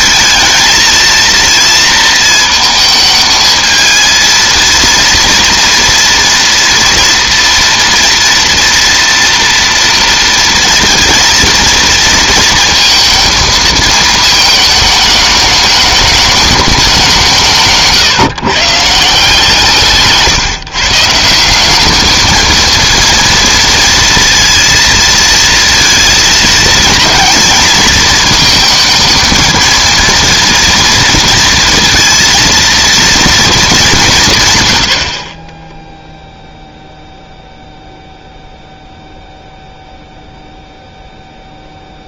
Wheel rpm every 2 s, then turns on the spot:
230, 220, 230, 230, 240, 230, 230, 210, 200, 160, 150, 230, 230, 230, 220, 240, 230, 100, 0, 0, 0.
none